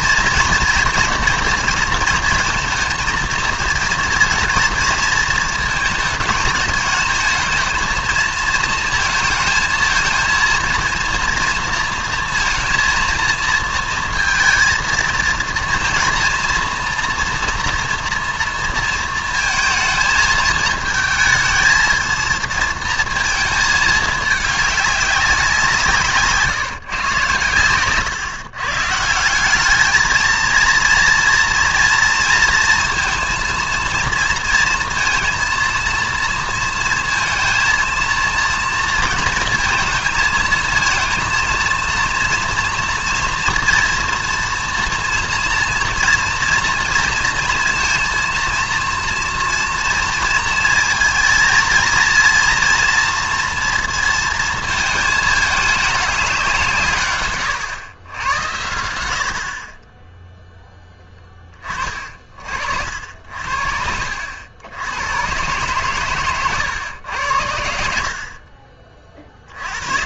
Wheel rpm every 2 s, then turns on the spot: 230, 230, 230, 220, 220, 230, 230, 230, 230, 230, 220, 230, 210, 150, 140, 230, 230, 230, 230, 230, 230, 230, 230, 230, 230, 230, 240, 220, 160, 90, 10, 60, 90, 120, 50.
none